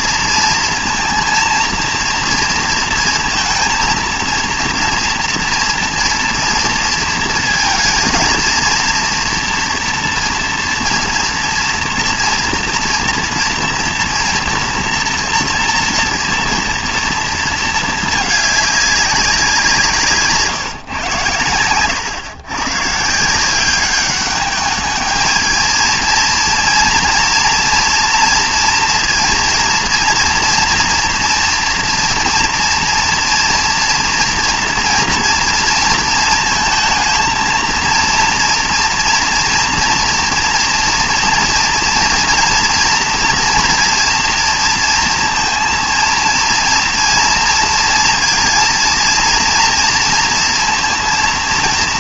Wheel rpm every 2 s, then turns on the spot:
230, 230, 230, 230, 230, 230, 230, 230, 230, 210, 140, 130, 210, 230, 230, 230, 230, 240, 230, 230, 240, 230, 230, 230, 230, 230.
none